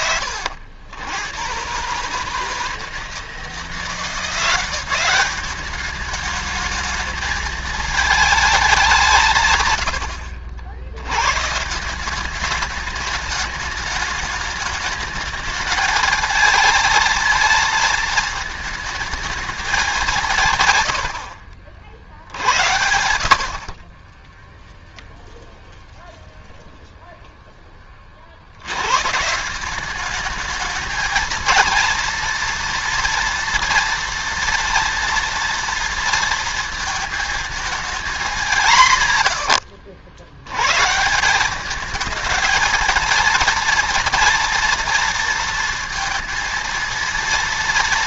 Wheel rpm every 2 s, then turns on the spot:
100, 160, 180, 210, 190, 70, 200, 210, 220, 220, 120, 70, 0, 0, 90, 220, 230, 240, 230, 160, 120, 220, 230, 230.
none